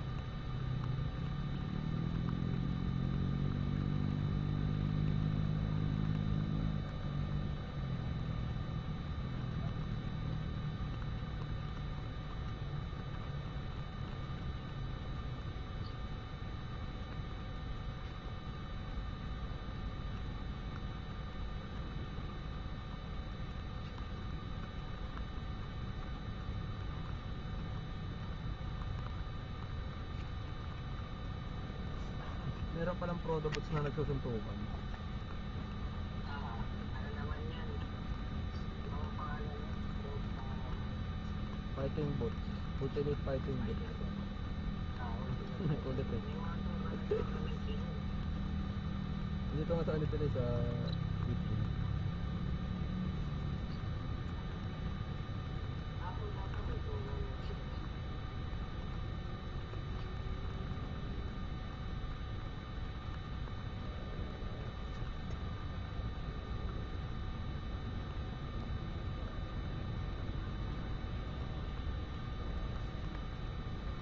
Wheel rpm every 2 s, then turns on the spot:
0, 0, 0, 0, 0, 0, 0, 0, 0, 0, 0, 0, 0, 0, 0, 0, 0, 0, 0, 0, 0, 0, 0, 0, 0, 0, 0, 0, 0, 0, 0, 0, 0, 0, 0, 0, 0.
none